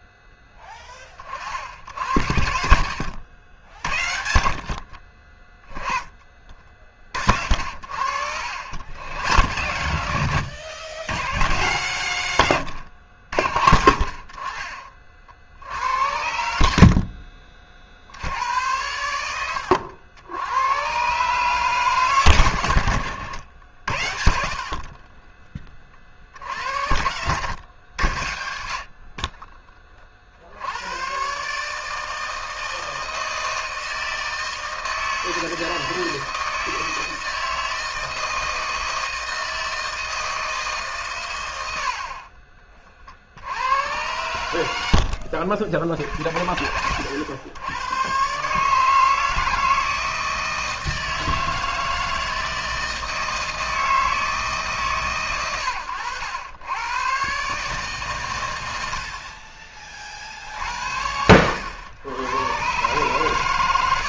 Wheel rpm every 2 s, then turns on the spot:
20, 70, 60, 30, 70, 100, 110, 50, 60, 90, 100, 90, 40, 70, 60, 90, 160, 160, 160, 160, 150, 30, 90, 100, 150, 160, 160, 150, 100, 90, 60, 120.
none